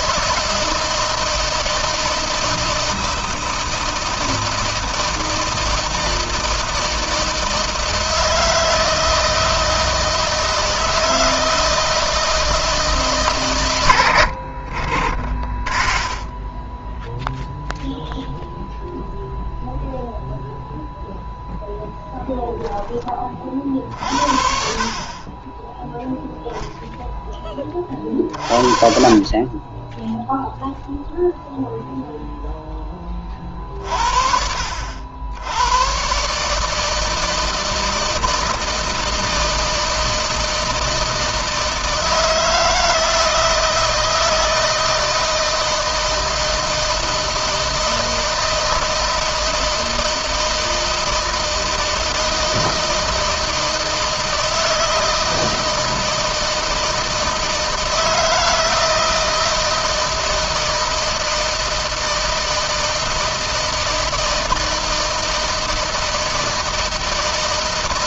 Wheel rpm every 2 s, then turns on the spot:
160, 160, 160, 160, 160, 160, 160, 30, 0, 0, 0, 20, 40, 0, 60, 0, 10, 80, 160, 160, 160, 160, 160, 160, 160, 160, 160, 160, 160, 160, 170, 160, 160, 160.
none